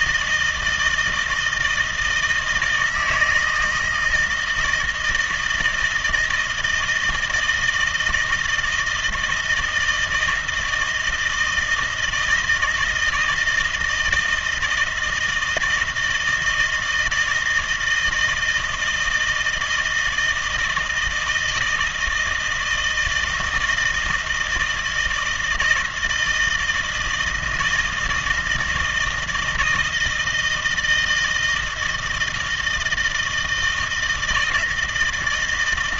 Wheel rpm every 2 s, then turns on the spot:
160, 160, 160, 160, 160, 160, 160, 160, 160, 160, 160, 160, 170, 160, 160, 160, 160, 160.
none